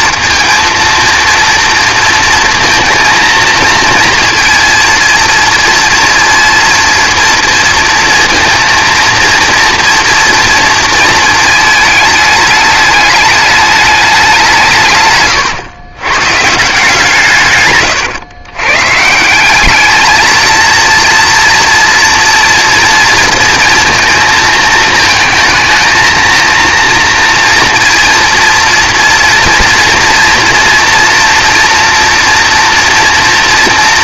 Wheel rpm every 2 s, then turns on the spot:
230, 230, 230, 230, 230, 230, 210, 180, 150, 120, 230, 240, 230, 230, 230, 230, 230.
none